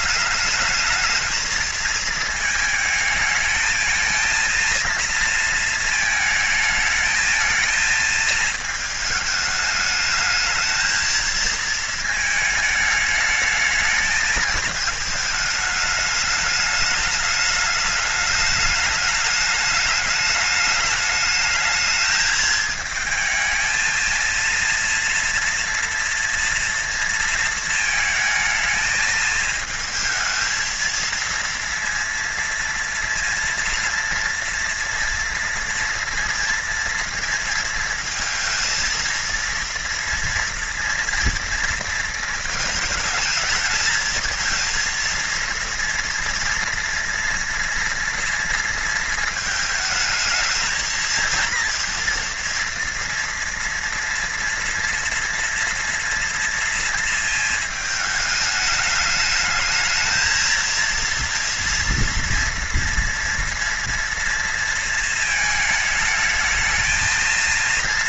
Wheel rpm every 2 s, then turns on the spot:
210, 220, 230, 220, 220, 220, 220, 220, 210, 210, 210, 220, 230, 230, 220, 220, 230, 230, 230, 230, 230, 220, 230, 230, 230, 230, 230, 230, 230, 210, 230, 230, 220, 220.
none